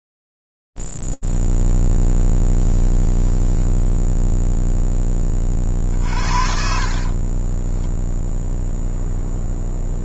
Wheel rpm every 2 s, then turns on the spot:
0, 0, 0, 60, 0.
6-8